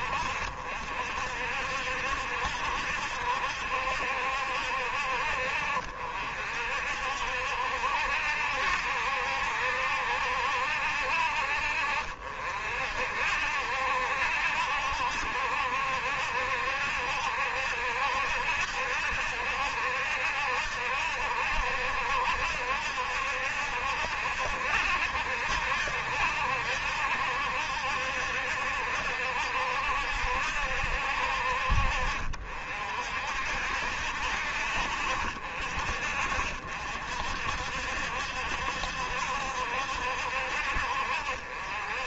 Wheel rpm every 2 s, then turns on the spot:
60, 70, 60, 60, 70, 70, 60, 70, 70, 70, 70, 70, 70, 70, 70, 60, 60, 60, 50, 70, 60.
none